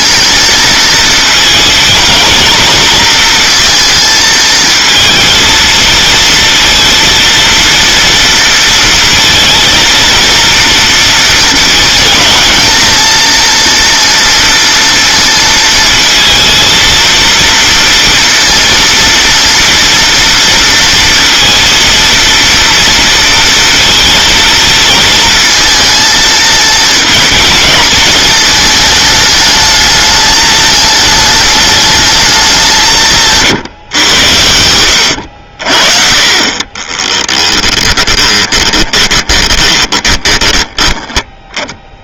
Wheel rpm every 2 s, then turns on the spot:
230, 220, 230, 230, 230, 230, 230, 230, 230, 230, 230, 230, 230, 230, 210, 210, 160, 90, 30, 30, 10.
36-40